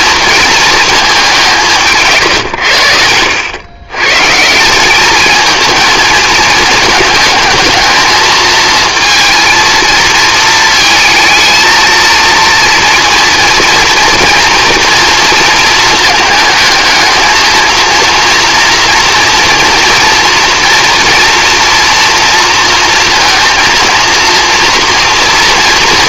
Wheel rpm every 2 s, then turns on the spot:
220, 100, 180, 220, 220, 220, 230, 230, 220, 230, 230, 230, 230.
none